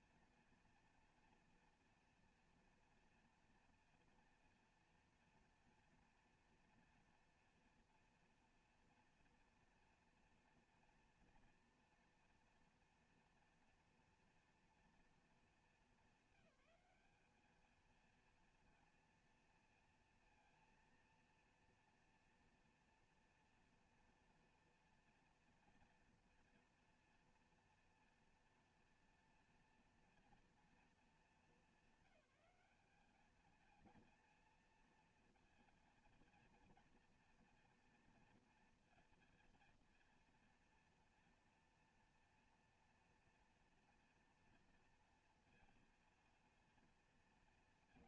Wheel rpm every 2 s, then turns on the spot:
230, 230, 230, 230, 240, 230, 230, 230, 200, 230, 230, 230, 240, 230, 230, 230, 210, 230, 230, 230, 230, 230, 230, 230.
none